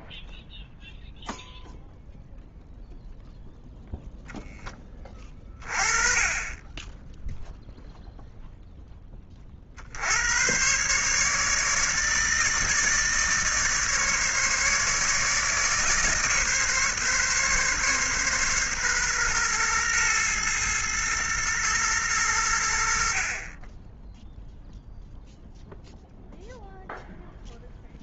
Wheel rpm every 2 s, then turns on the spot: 0, 0, 10, 20, 10, 120, 150, 150, 150, 130, 110, 80, 0, 0.
none